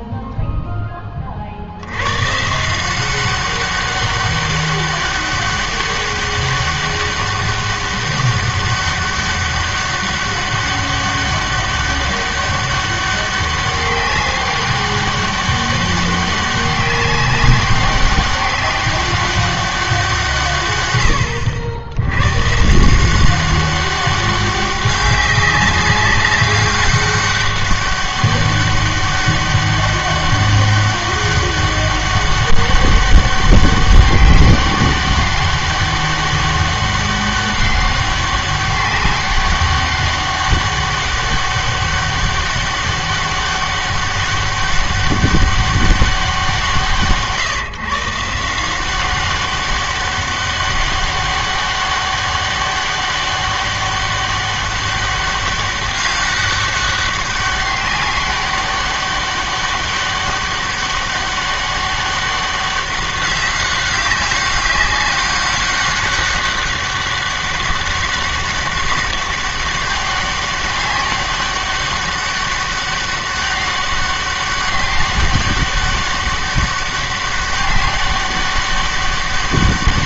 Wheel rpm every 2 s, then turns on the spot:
30, 190, 200, 200, 200, 200, 200, 200, 200, 200, 90, 180, 200, 200, 200, 200, 200, 200, 200, 200, 200, 200, 200, 150, 190, 200, 200, 200, 200, 200, 200, 200, 200, 200, 200, 200, 200, 200, 200, 200.
none